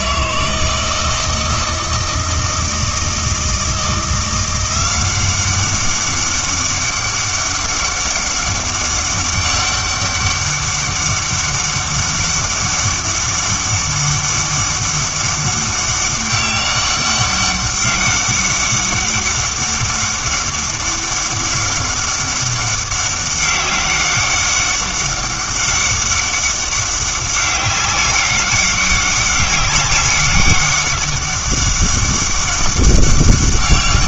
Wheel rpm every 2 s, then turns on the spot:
160, 160, 180, 200, 200, 200, 200, 200, 200, 200, 200, 200, 200, 200, 200, 200, 200.
none